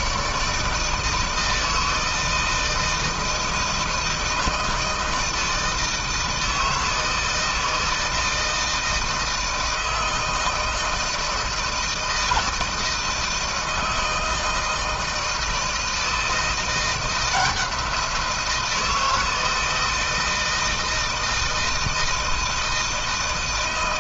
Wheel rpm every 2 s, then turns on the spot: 160, 160, 160, 160, 160, 160, 160, 160, 170, 170, 160, 160.
none